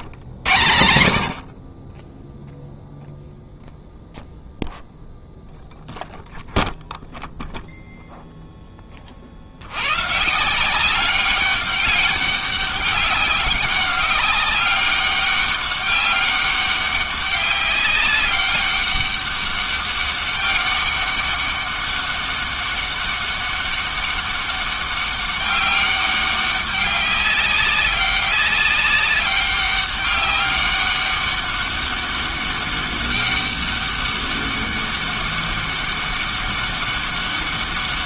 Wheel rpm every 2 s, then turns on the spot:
150, 0, 0, 0, 0, 150, 200, 190, 200, 200, 200, 200, 200, 200, 200, 200, 200, 200, 200.
none